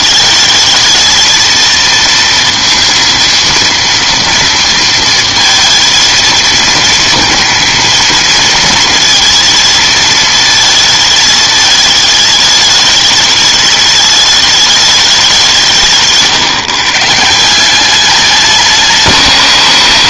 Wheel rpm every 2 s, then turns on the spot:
220, 230, 230, 220, 220, 220, 210, 210, 140, 190.
none